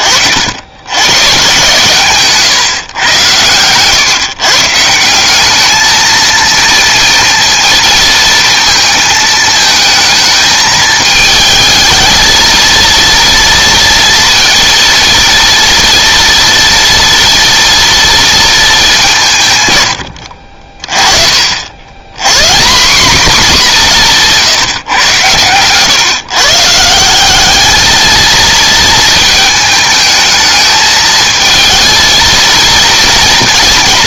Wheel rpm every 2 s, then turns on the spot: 90, 130, 150, 230, 230, 220, 230, 230, 230, 220, 50, 180, 150, 150, 220, 220, 230.
none